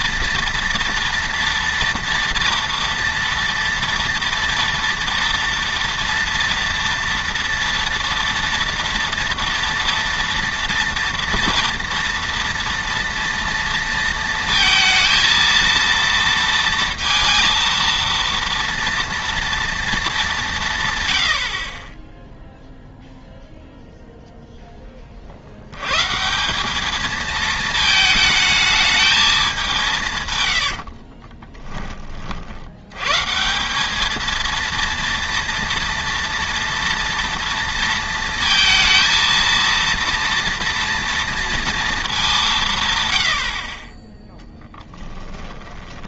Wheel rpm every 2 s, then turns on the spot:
230, 230, 230, 230, 230, 230, 230, 230, 230, 230, 150, 0, 10, 190, 220, 80, 80, 230, 230, 230, 230, 160, 10.
30-32 44-46